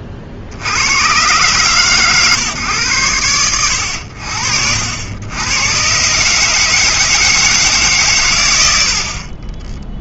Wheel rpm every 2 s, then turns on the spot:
50, 120, 70, 150, 110.
none